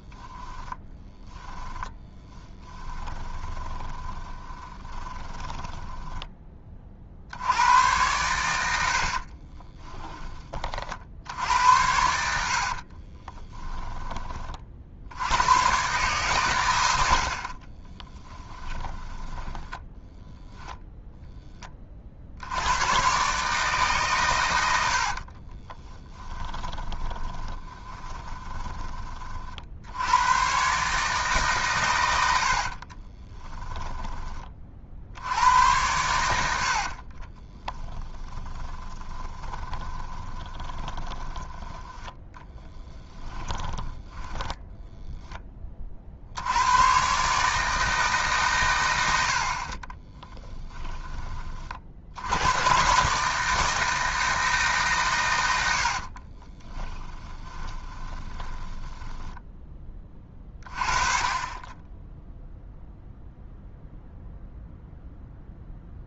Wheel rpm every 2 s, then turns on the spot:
10, 20, 20, 40, 80, 50, 50, 50, 100, 20, 0, 100, 90, 20, 20, 140, 40, 50, 60, 10, 20, 10, 10, 110, 120, 10, 120, 140, 20, 10, 30, 0, 0.
0-6 12-14 18-20 26-28 32-34 36-46 50-52 56-60